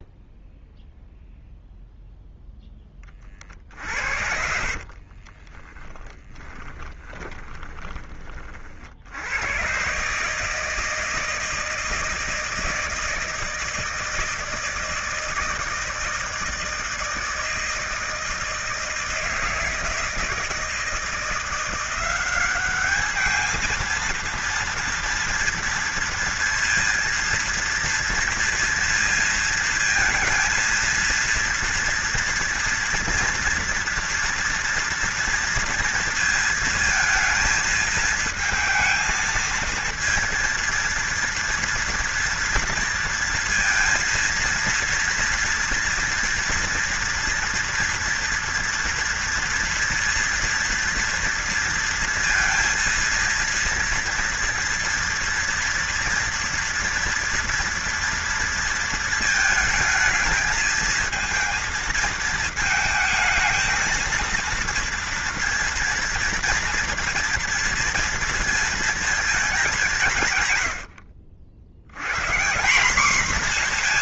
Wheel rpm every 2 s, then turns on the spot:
0, 10, 50, 10, 50, 150, 160, 160, 160, 160, 170, 200, 230, 230, 230, 230, 230, 230, 230, 220, 230, 230, 230, 230, 230, 230, 230, 230, 230, 230, 220, 220, 230, 230, 230, 110, 180.
4-8